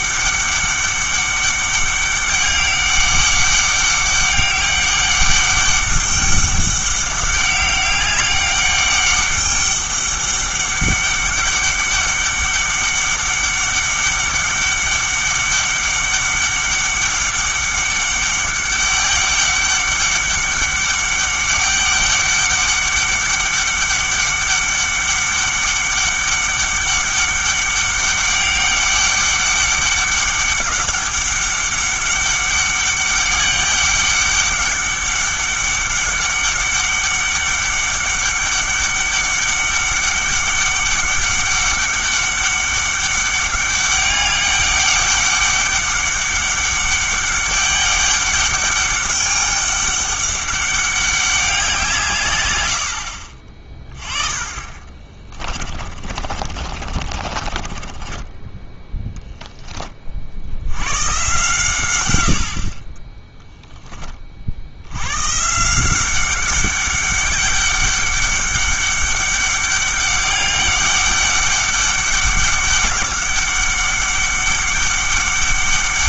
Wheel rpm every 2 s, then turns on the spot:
200, 200, 200, 200, 200, 200, 200, 200, 200, 200, 200, 200, 200, 200, 200, 200, 200, 200, 200, 200, 200, 200, 200, 200, 200, 200, 90, 30, 40, 10, 90, 40, 70, 190, 200, 200, 200, 200.
54-58